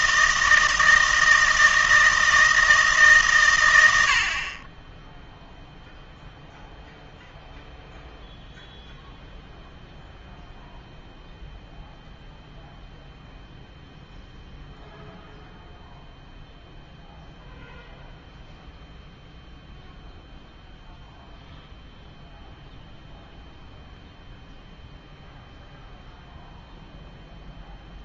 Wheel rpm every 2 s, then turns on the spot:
160, 160, 20, 0, 0, 0, 0, 0, 0, 0, 0, 0, 0, 0.
none